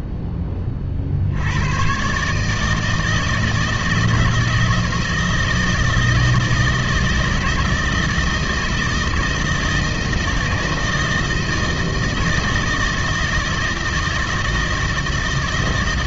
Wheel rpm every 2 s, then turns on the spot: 70, 160, 160, 160, 160, 160, 160, 160.
none